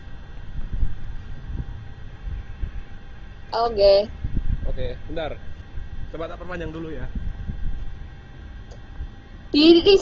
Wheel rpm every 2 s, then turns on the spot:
0, 0, 0, 0, 0.
none